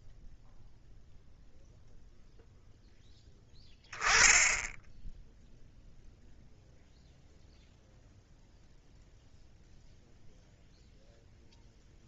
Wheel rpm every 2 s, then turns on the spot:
0, 0, 0, 0, 0, 0.
none